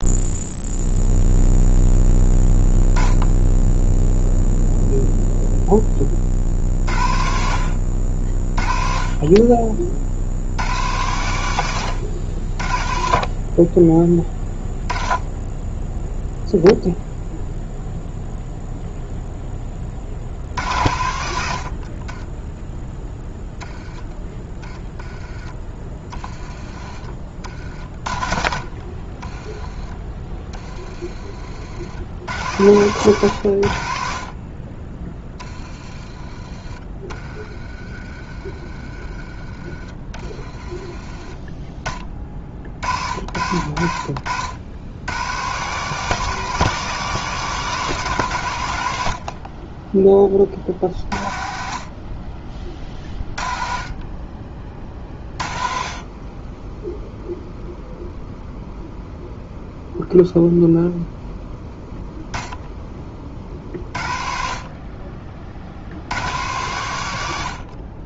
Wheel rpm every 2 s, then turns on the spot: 0, 10, 0, 50, 30, 90, 60, 10, 0, 0, 80, 0, 10, 30, 40, 20, 100, 40, 30, 30, 20, 50, 80, 180, 110, 40, 30, 30, 10, 0, 0, 10, 40, 100.
40-42